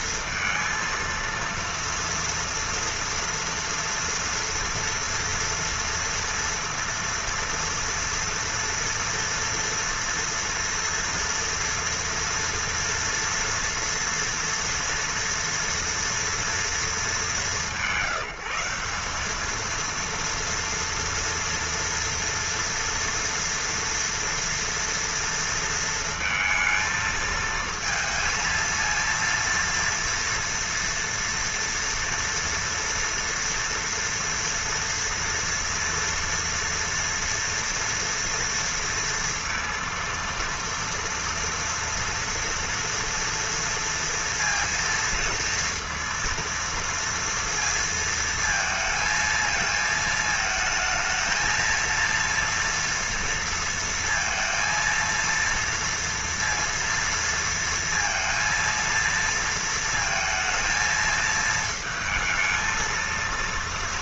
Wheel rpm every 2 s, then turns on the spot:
230, 230, 230, 230, 230, 230, 240, 240, 230, 200, 240, 230, 230, 220, 230, 230, 230, 230, 230, 230, 230, 230, 230, 230, 230, 220, 230, 230, 230, 230, 220, 230.
none